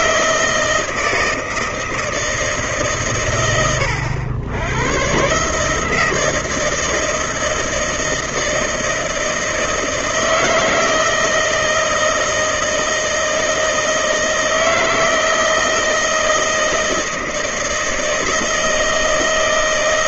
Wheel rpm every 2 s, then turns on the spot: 160, 150, 100, 160, 160, 160, 160, 160, 160, 160.
none